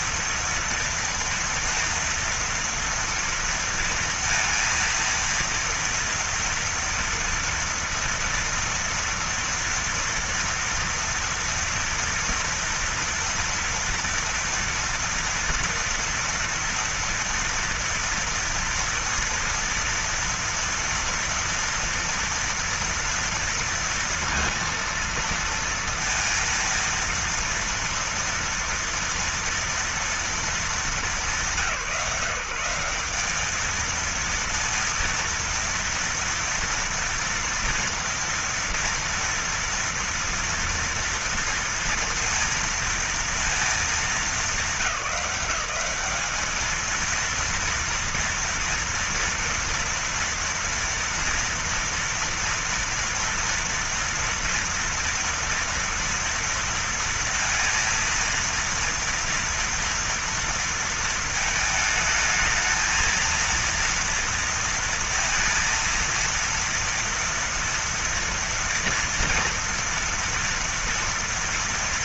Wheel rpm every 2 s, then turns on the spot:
230, 230, 230, 230, 230, 230, 230, 230, 230, 230, 230, 230, 230, 230, 230, 230, 170, 230, 230, 230, 230, 230, 210, 220, 230, 230, 230, 240, 230, 230, 230, 220, 230, 230, 230, 230.
none